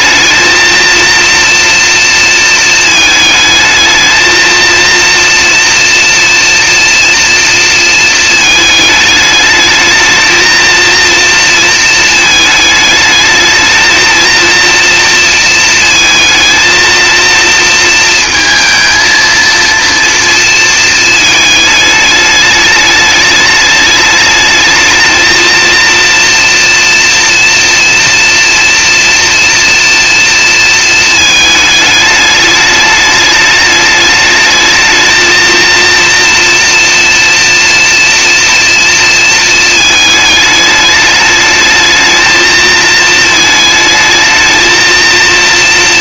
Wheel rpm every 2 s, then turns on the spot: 230, 220, 230, 230, 210, 230, 210, 230, 230, 230, 220, 210, 220, 230, 230, 230, 210, 220, 230, 230, 210, 220, 220.
none